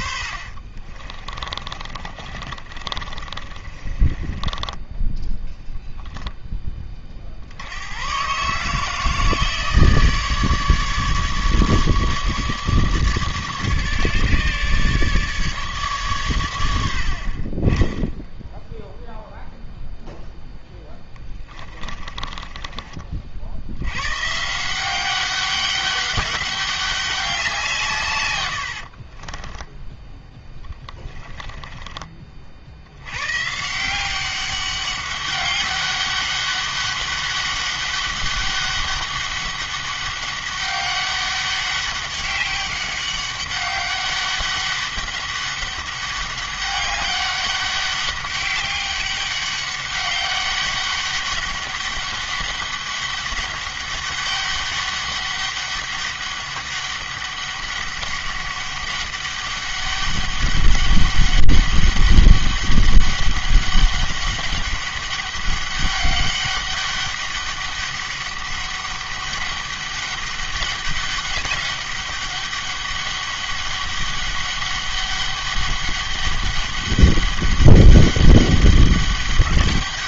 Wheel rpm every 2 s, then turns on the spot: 40, 40, 20, 20, 150, 150, 150, 150, 70, 0, 10, 30, 180, 200, 60, 10, 70, 200, 200, 200, 200, 200, 200, 200, 200, 200, 200, 200, 200, 200, 200, 200, 200, 200, 200, 200, 200, 200, 200, 200.
0-6 20-24 28-32